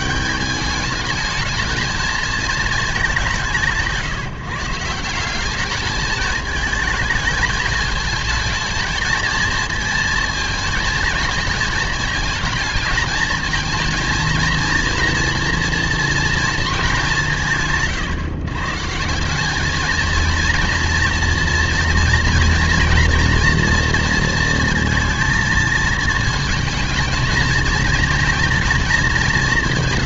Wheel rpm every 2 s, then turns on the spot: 200, 210, 160, 220, 220, 220, 220, 230, 220, 150, 230, 230, 230, 220, 230.
none